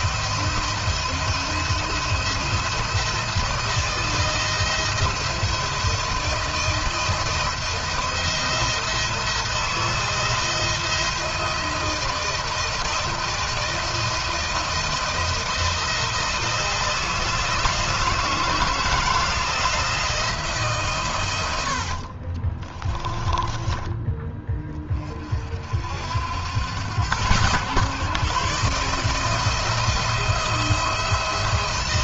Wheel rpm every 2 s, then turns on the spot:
170, 170, 170, 160, 170, 170, 160, 170, 160, 160, 160, 50, 30, 90, 140, 170.
22-24